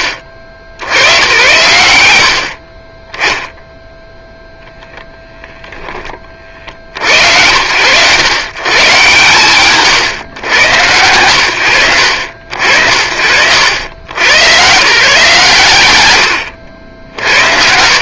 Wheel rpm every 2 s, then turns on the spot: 100, 20, 0, 70, 100, 80, 70, 160, 60.
none